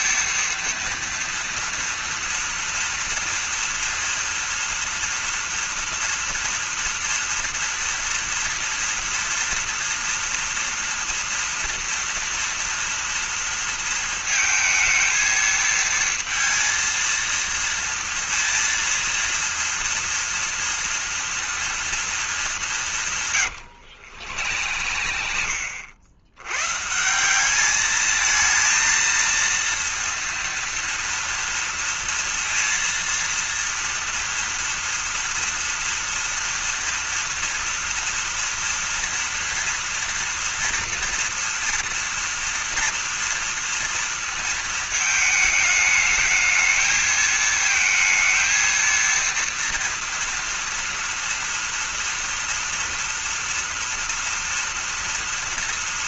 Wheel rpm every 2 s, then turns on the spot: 230, 230, 240, 240, 230, 230, 230, 220, 230, 230, 230, 200, 90, 130, 230, 230, 230, 230, 230, 230, 230, 230, 220, 220, 230, 230, 230, 230.
24-26